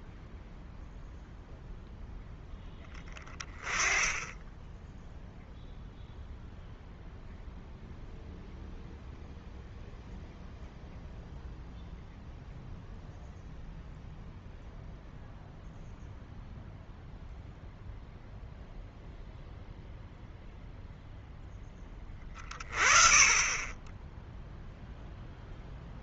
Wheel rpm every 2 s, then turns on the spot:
0, 10, 0, 0, 0, 0, 0, 0, 0, 0, 0, 30, 0.
none